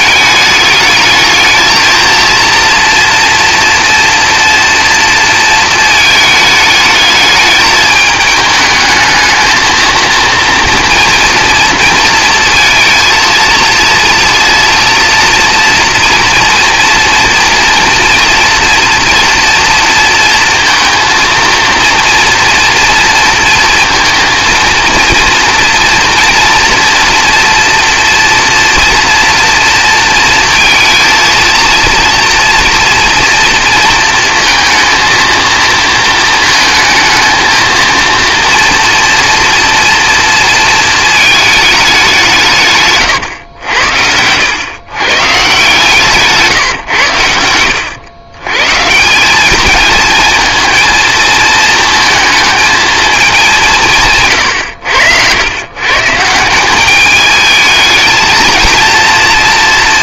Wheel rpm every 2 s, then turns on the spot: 210, 230, 230, 210, 220, 230, 230, 230, 230, 230, 230, 230, 230, 230, 230, 230, 230, 230, 220, 240, 230, 140, 110, 140, 140, 220, 220, 90, 190, 230.
none